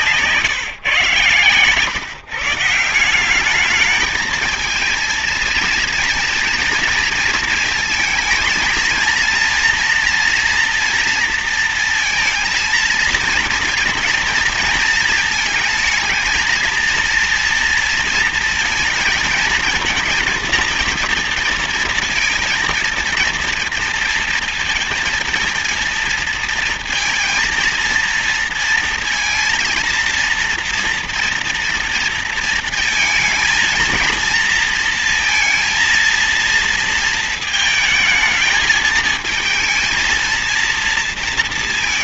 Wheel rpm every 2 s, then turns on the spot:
140, 160, 220, 230, 220, 230, 230, 230, 230, 230, 230, 230, 230, 230, 230, 230, 230, 230, 230, 220, 230.
none